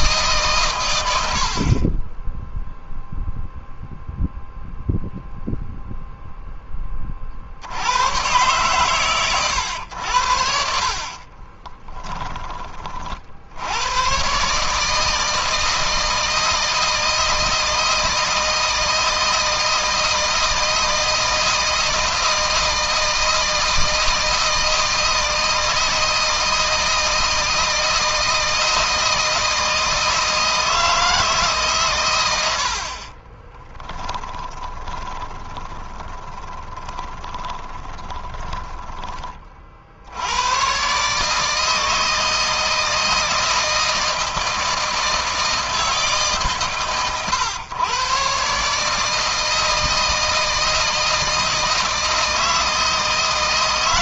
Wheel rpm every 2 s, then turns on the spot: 110, 0, 0, 20, 120, 50, 40, 160, 160, 160, 160, 160, 160, 160, 160, 160, 60, 20, 20, 20, 130, 160, 160, 130, 140, 160, 160.
32-38